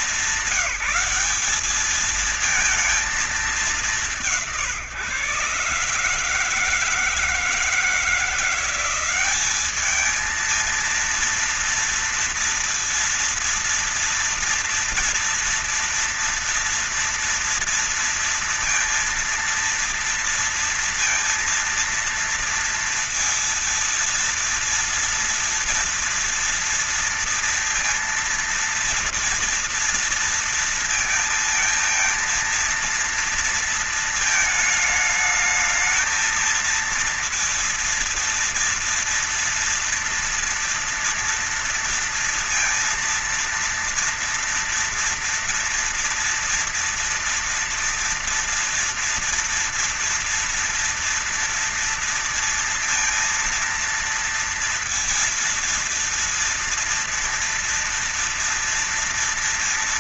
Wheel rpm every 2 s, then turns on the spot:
200, 220, 150, 150, 170, 220, 230, 230, 240, 230, 230, 230, 230, 230, 230, 230, 230, 220, 220, 230, 230, 230, 230, 230, 240, 230, 230, 230, 240, 230.
none